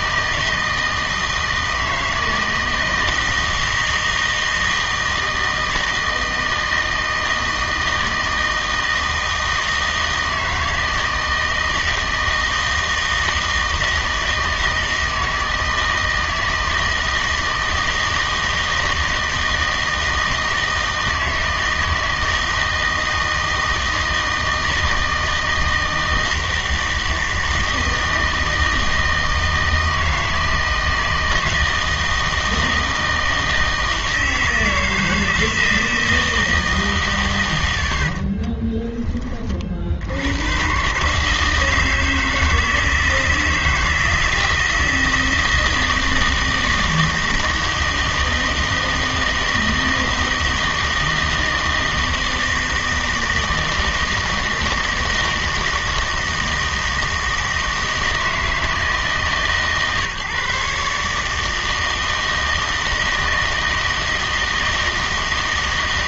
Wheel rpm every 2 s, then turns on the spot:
160, 160, 160, 160, 160, 160, 160, 160, 160, 160, 160, 160, 160, 160, 160, 160, 160, 160, 160, 20, 120, 160, 160, 160, 160, 160, 160, 160, 160, 160, 150, 160, 160.
38-40